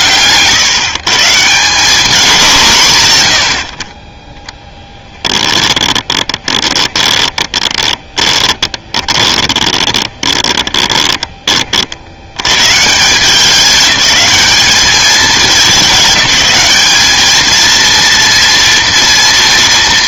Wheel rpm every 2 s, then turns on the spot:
140, 180, 20, 20, 20, 10, 120, 210, 210, 230.
4-12